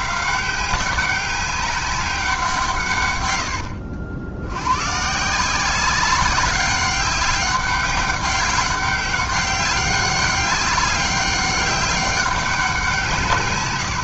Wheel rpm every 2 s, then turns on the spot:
190, 130, 130, 190, 200, 200, 170.
none